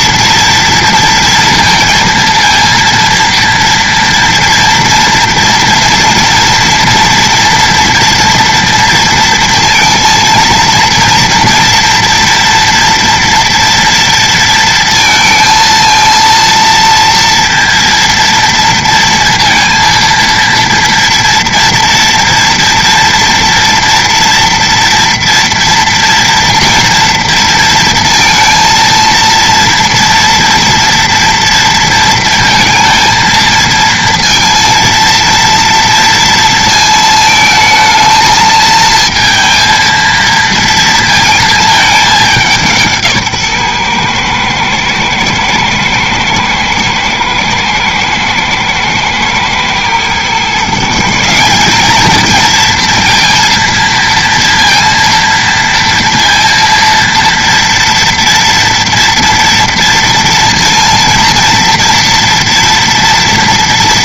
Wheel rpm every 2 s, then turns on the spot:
230, 230, 230, 230, 230, 230, 240, 230, 230, 230, 230, 230, 240, 240, 230, 230, 230, 230, 220, 220, 230, 170, 110, 110, 120, 150, 230, 230, 230, 230, 230, 230.
none